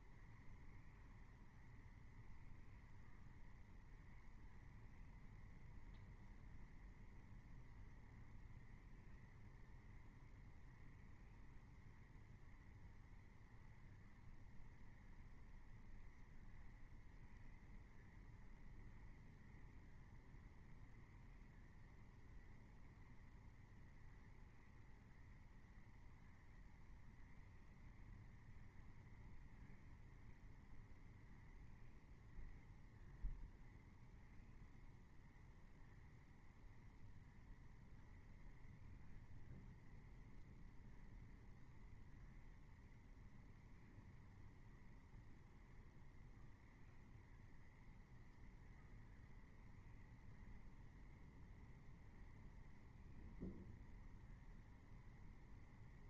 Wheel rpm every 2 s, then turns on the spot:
0, 0, 0, 0, 0, 0, 0, 0, 0, 0, 0, 0, 0, 0, 0, 0, 0, 0, 0, 0, 0, 0, 0, 0, 0, 0, 0, 0.
none